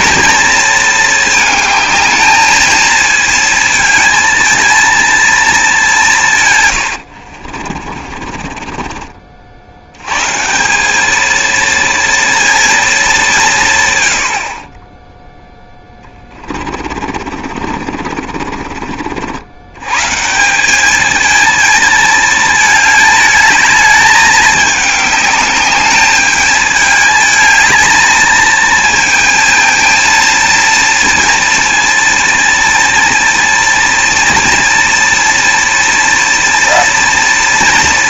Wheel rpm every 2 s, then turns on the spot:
230, 220, 230, 110, 20, 180, 230, 30, 40, 50, 190, 220, 210, 210, 220, 230, 230, 240, 230.
6-10 16-20